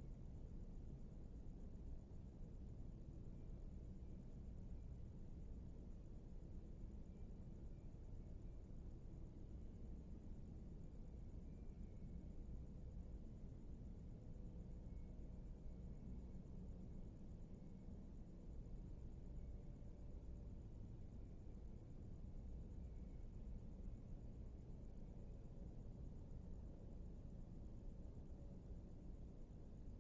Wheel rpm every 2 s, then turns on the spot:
0, 0, 0, 0, 0, 0, 0, 0, 0, 0, 0, 0, 0, 0, 0.
none